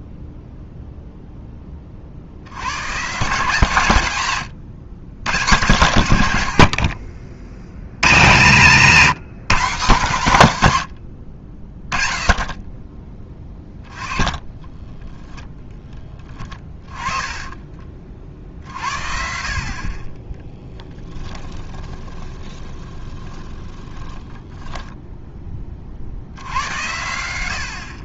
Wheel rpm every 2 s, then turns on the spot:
0, 90, 130, 50, 150, 100, 20, 20, 20, 50, 10, 20, 10, 80.
10-12 14-18 20-24